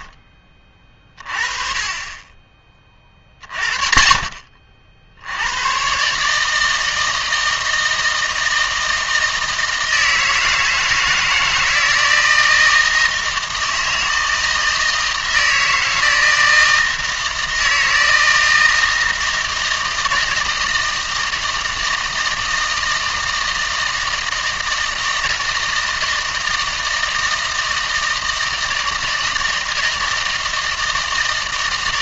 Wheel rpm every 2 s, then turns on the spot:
30, 30, 60, 160, 160, 160, 160, 160, 160, 160, 160, 160, 160, 160, 160, 160.
none